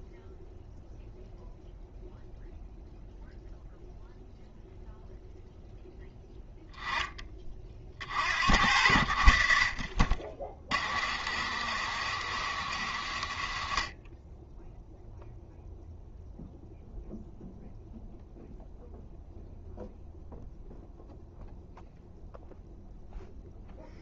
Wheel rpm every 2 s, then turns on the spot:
0, 0, 0, 10, 70, 80, 90, 0, 0, 0, 0, 0.
none